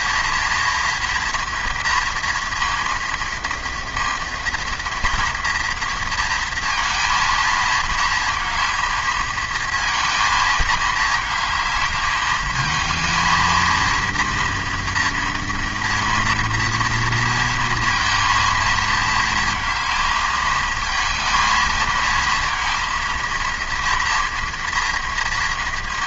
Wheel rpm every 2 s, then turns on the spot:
230, 230, 230, 230, 220, 220, 220, 230, 230, 230, 220, 230, 230.
none